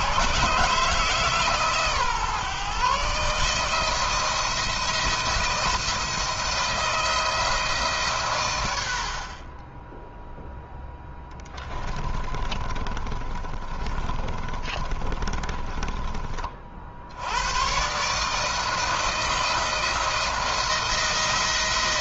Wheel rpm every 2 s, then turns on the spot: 150, 140, 170, 170, 90, 0, 30, 20, 50, 160, 160.
12-16